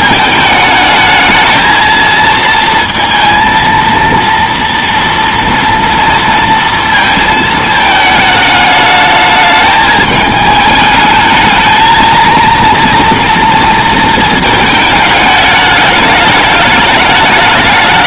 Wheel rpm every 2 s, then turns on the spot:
220, 230, 230, 220, 210, 220, 230, 210, 210.
none